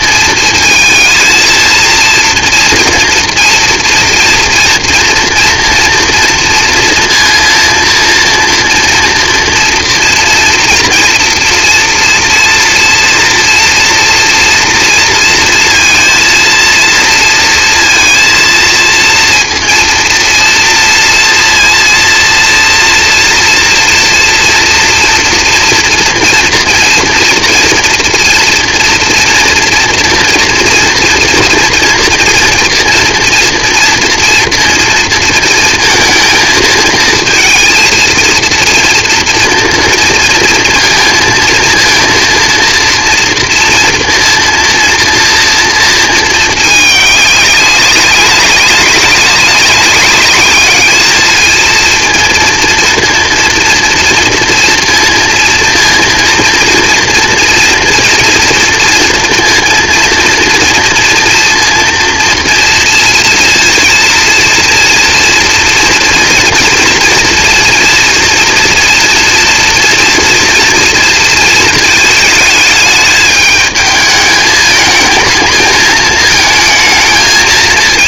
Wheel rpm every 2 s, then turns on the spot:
230, 230, 230, 230, 230, 230, 230, 230, 230, 230, 230, 230, 230, 240, 230, 230, 230, 230, 230, 230, 230, 230, 240, 210, 200, 210, 230, 230, 240, 230, 230, 230, 230, 230, 230, 230, 210, 220, 220.
none